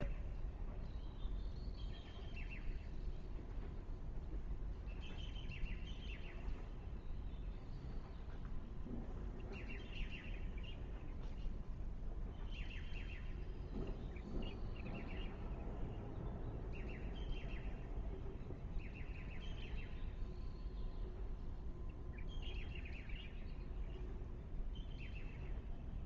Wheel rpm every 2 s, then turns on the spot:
0, 0, 0, 0, 0, 0, 0, 0, 0, 0, 0, 0, 0.
none